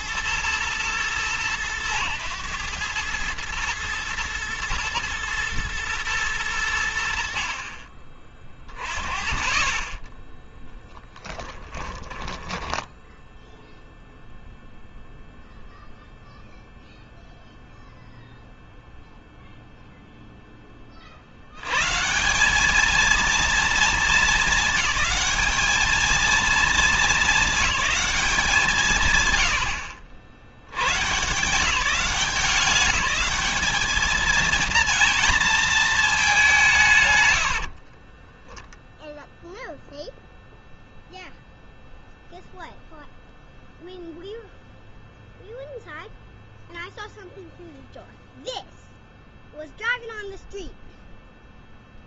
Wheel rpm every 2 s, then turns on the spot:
110, 100, 120, 80, 30, 10, 20, 0, 0, 0, 20, 200, 210, 220, 170, 100, 190, 230, 160, 0, 0, 0, 0, 0, 0, 0.
10-14